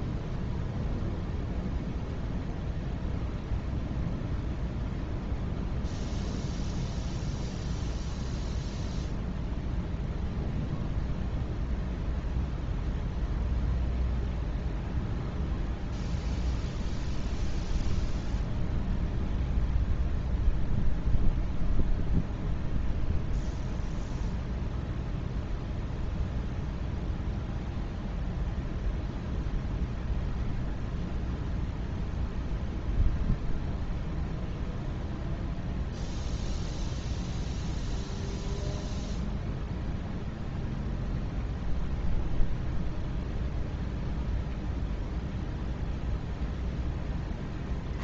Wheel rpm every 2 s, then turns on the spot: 0, 0, 0, 0, 0, 0, 0, 0, 0, 0, 0, 0, 0, 0, 0, 0, 0, 0, 0, 0, 0, 0, 0, 0.
none